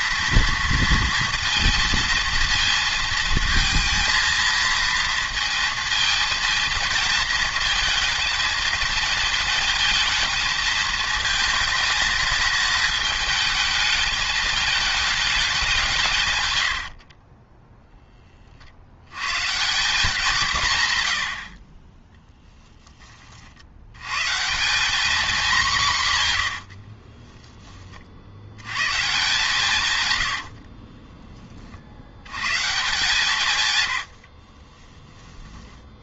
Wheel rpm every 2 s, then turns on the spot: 230, 230, 230, 230, 220, 220, 210, 210, 90, 40, 150, 10, 190, 90, 110, 40, 140, 30.
16-18 26-28 30-32 34-36